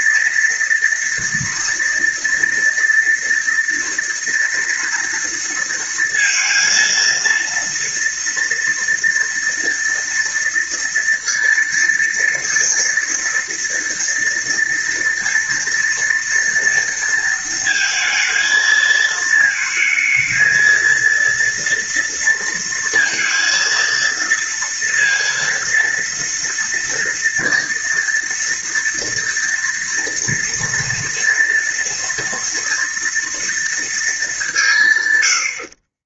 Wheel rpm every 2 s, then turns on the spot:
230, 230, 230, 230, 230, 230, 230, 230, 230, 220, 230, 230, 230, 230, 240, 230, 230, 160.
none